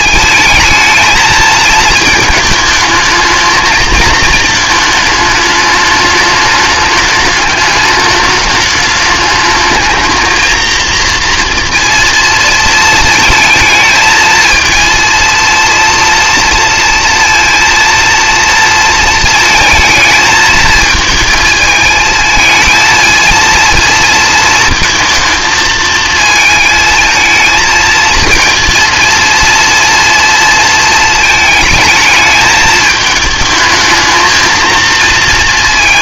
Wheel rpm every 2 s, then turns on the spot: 220, 220, 220, 210, 210, 230, 230, 230, 240, 230, 220, 220, 230, 220, 230, 230, 210, 230.
none